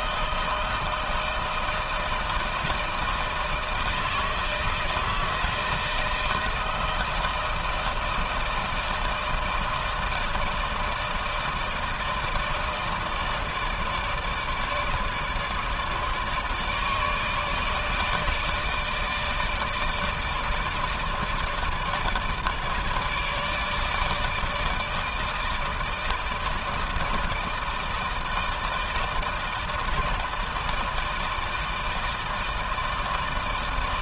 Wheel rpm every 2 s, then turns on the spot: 160, 160, 160, 160, 160, 160, 160, 150, 150, 150, 150, 160, 160, 160, 160, 160, 160.
none